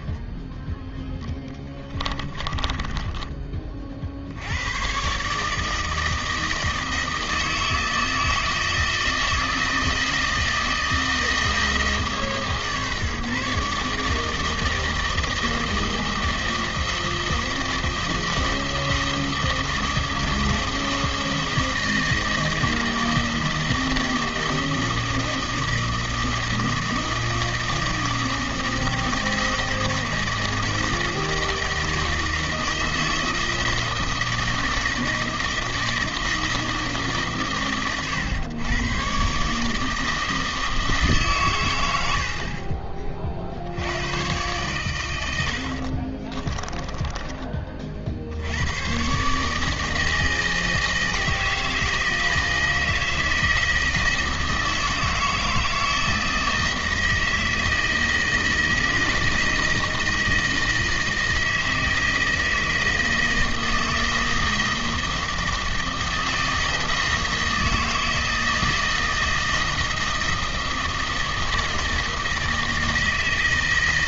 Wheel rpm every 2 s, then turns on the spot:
10, 20, 140, 160, 160, 160, 150, 160, 160, 160, 160, 160, 160, 160, 160, 160, 160, 160, 150, 120, 150, 30, 100, 20, 120, 160, 160, 160, 160, 160, 160, 160, 160, 160, 160, 160, 160.
0-2 46-48